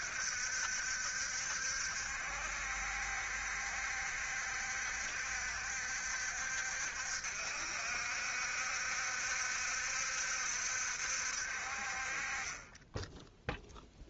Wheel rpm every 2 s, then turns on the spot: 60, 70, 70, 60, 70, 60, 10.
none